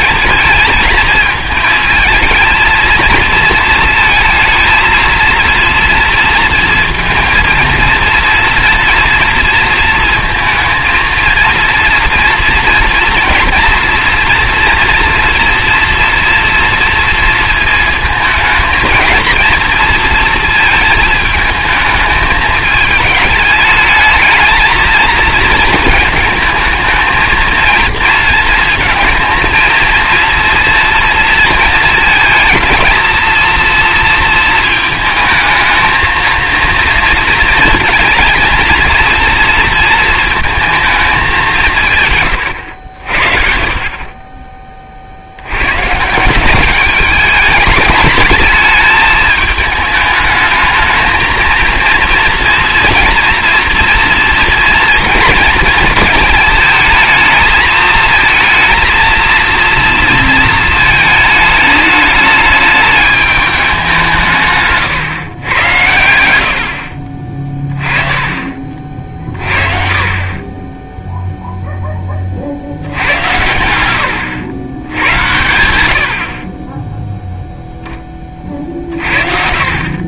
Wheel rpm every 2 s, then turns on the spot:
220, 220, 230, 230, 230, 230, 230, 230, 230, 230, 230, 210, 220, 220, 230, 230, 220, 220, 230, 230, 220, 100, 30, 200, 220, 220, 230, 230, 220, 220, 220, 210, 130, 60, 40, 20, 60, 110, 20, 40.
64-66